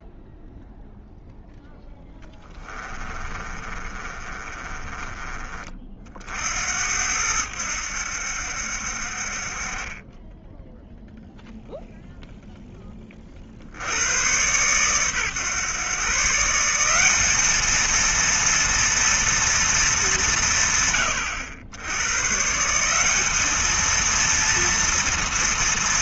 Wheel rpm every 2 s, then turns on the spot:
0, 20, 30, 80, 60, 10, 10, 120, 170, 230, 150, 160, 230.
2-6